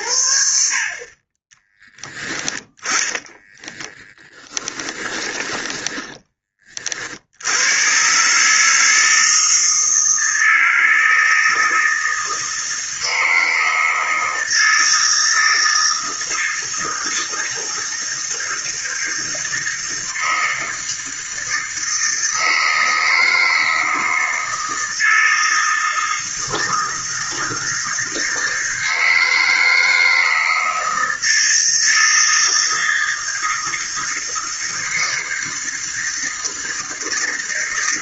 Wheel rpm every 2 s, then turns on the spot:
50, 10, 20, 50, 160, 160, 160, 160, 160, 160, 160, 160, 160, 160, 160, 160, 160, 160, 160.
4-6